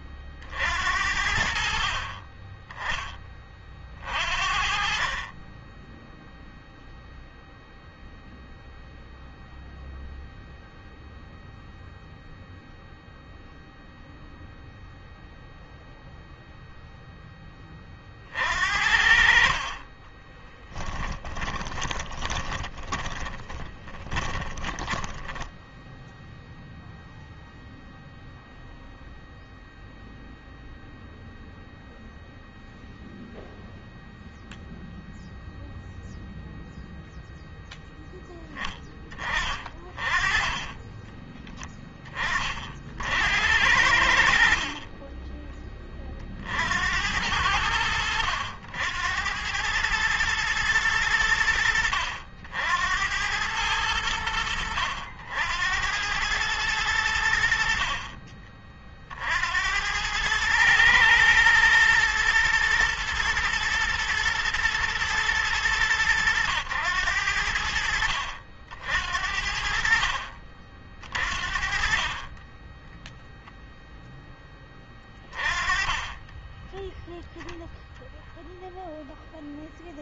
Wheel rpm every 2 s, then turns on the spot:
60, 20, 40, 0, 0, 0, 0, 0, 0, 60, 10, 10, 10, 0, 0, 0, 0, 0, 0, 20, 10, 60, 30, 80, 90, 90, 90, 80, 90, 50, 110, 120, 110, 90, 70, 40, 10, 20, 0, 0.
20-26 44-46